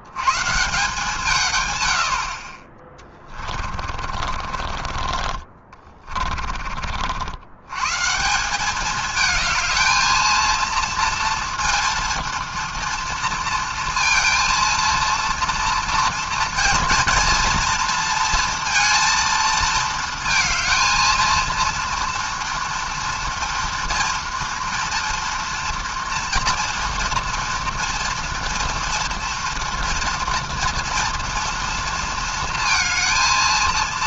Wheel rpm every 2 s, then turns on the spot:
130, 50, 40, 30, 170, 230, 230, 230, 220, 230, 220, 230, 230, 230, 230, 230, 230.
4-8